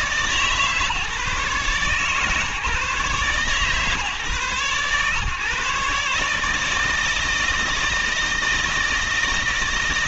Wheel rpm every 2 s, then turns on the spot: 140, 140, 130, 150, 160.
none